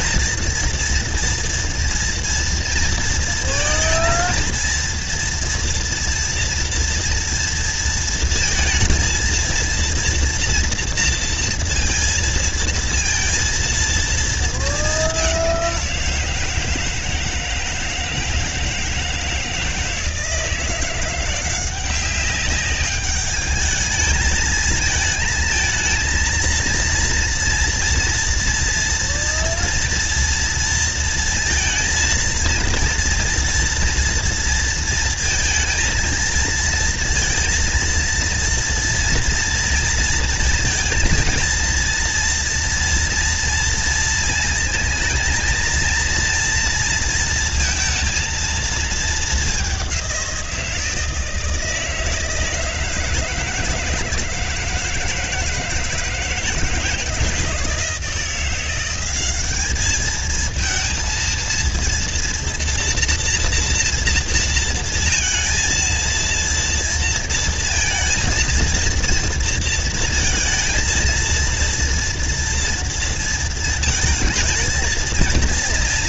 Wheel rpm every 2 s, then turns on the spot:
230, 230, 230, 240, 230, 230, 230, 220, 170, 160, 160, 200, 220, 230, 240, 230, 230, 230, 230, 230, 230, 230, 230, 230, 230, 180, 160, 160, 160, 170, 220, 230, 230, 230, 230, 230, 230, 220.
none